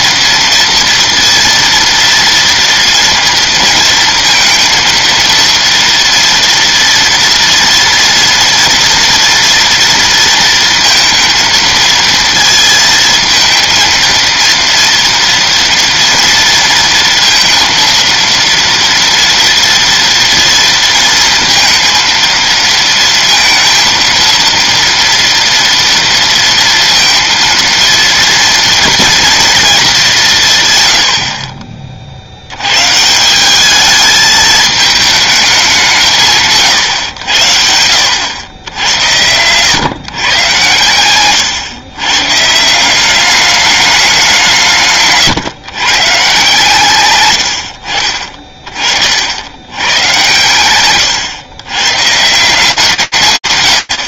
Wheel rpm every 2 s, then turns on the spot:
230, 230, 230, 230, 230, 230, 220, 230, 230, 230, 230, 230, 230, 230, 230, 140, 90, 220, 150, 100, 130, 150, 180, 130, 30, 110, 170.
none